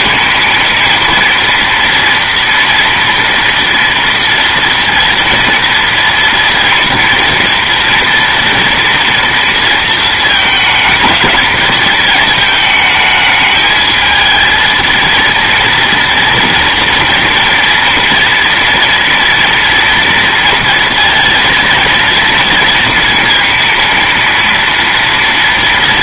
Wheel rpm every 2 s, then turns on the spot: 230, 230, 230, 230, 230, 210, 220, 230, 230, 230, 230, 230, 230.
none